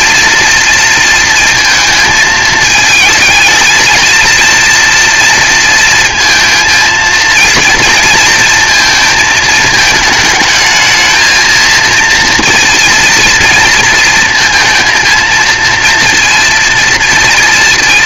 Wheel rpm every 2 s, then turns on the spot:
220, 230, 230, 230, 220, 230, 230, 240, 230.
none